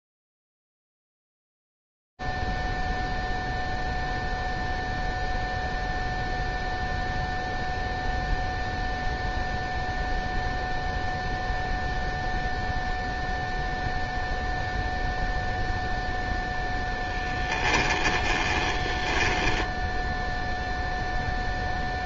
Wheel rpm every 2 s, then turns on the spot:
0, 0, 0, 0, 0, 0, 0, 0, 0, 10, 0.
18-20